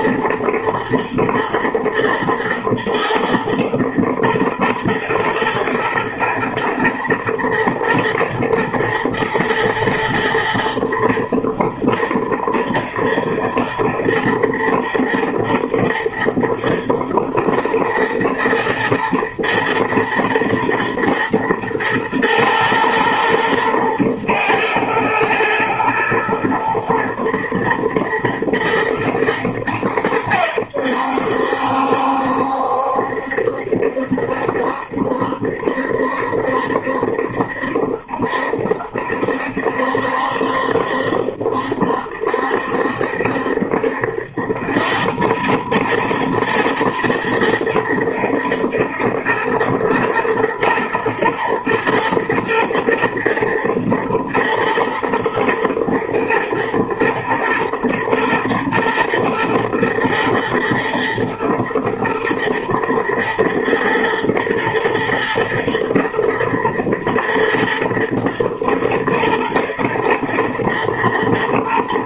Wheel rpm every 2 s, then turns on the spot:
120, 110, 120, 110, 110, 120, 110, 120, 110, 110, 110, 110, 120, 120, 120, 80, 70, 70, 70, 70, 70, 70, 90, 110, 120, 110, 110, 110, 120, 120, 110, 120, 120, 120, 120, 110.
none